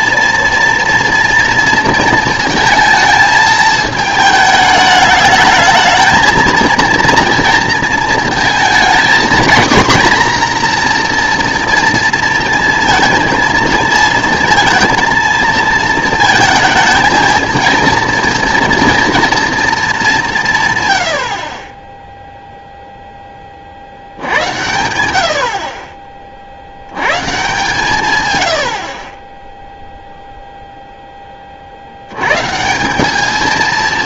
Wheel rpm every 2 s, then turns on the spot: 230, 230, 210, 230, 230, 240, 230, 220, 220, 230, 130, 0, 100, 70, 80, 0, 160.
none